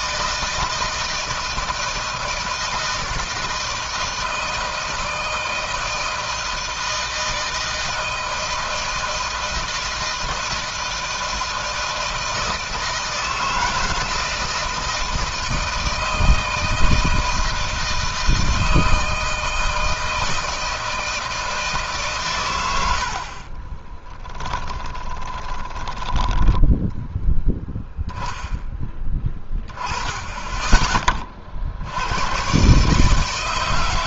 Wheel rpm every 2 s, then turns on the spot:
160, 160, 160, 160, 160, 160, 160, 160, 160, 160, 160, 100, 10, 10, 10, 20, 130.
24-28